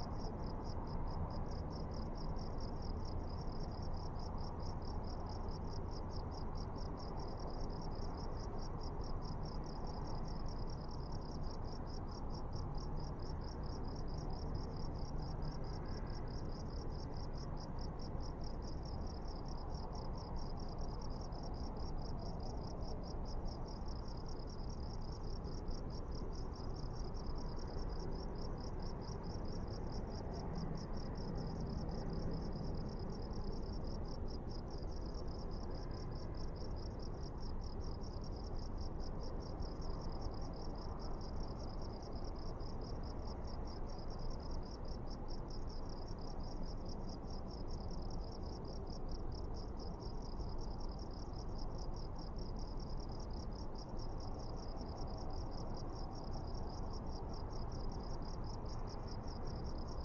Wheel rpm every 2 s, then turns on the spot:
0, 0, 0, 0, 0, 0, 0, 0, 0, 0, 0, 0, 0, 0, 0, 0, 0, 0, 0, 0, 0, 0, 0, 0, 0, 0, 0, 0, 0, 0.
none